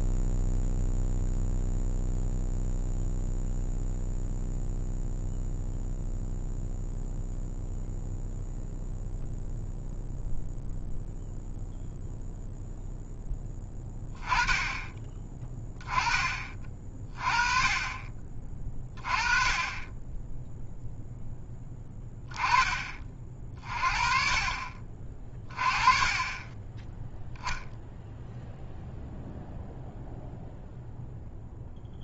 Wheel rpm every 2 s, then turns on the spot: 0, 0, 0, 0, 0, 0, 0, 20, 40, 30, 0, 20, 40, 10, 0, 0.
none